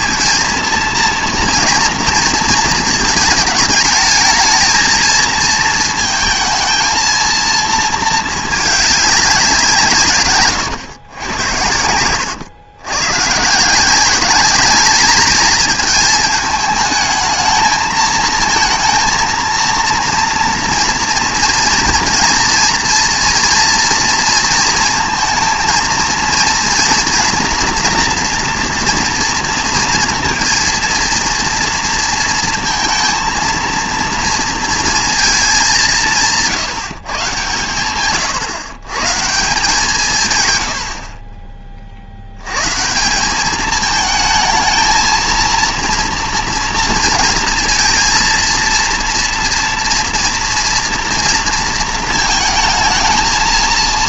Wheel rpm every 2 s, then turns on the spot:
230, 220, 220, 230, 210, 110, 120, 210, 220, 230, 230, 230, 230, 240, 230, 230, 220, 230, 160, 130, 90, 140, 220, 230, 230, 240, 220.
none